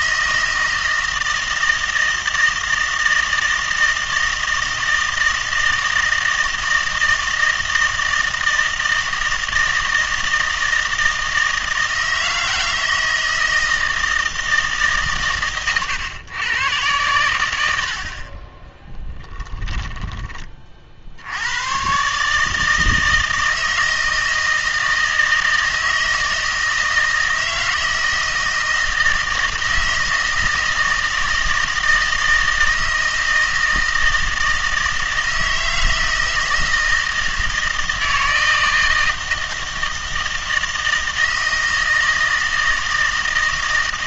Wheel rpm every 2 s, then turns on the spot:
160, 160, 160, 160, 160, 160, 160, 150, 110, 10, 50, 160, 160, 160, 160, 160, 160, 160, 160, 160, 160, 160.
18-20